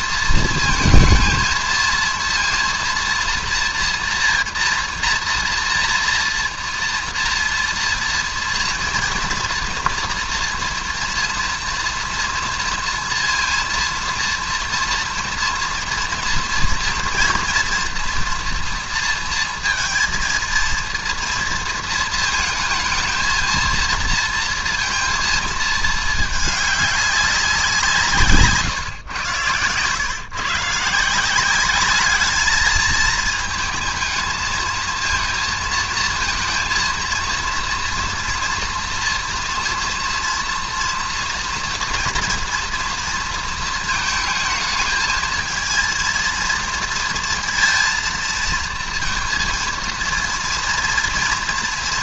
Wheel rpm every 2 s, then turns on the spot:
220, 230, 230, 230, 230, 230, 230, 230, 230, 240, 230, 230, 230, 210, 140, 140, 220, 220, 230, 230, 230, 230, 220, 230, 230, 230.
none